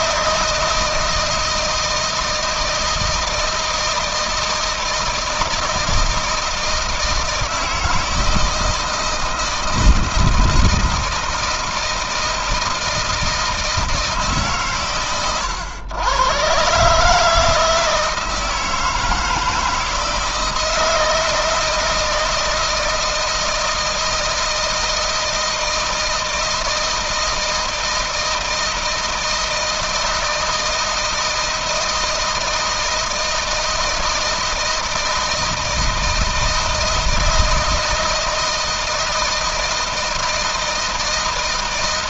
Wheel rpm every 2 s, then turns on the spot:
160, 160, 160, 160, 160, 160, 160, 150, 130, 160, 160, 160, 160, 160, 160, 160, 160, 160, 160, 160, 160.
none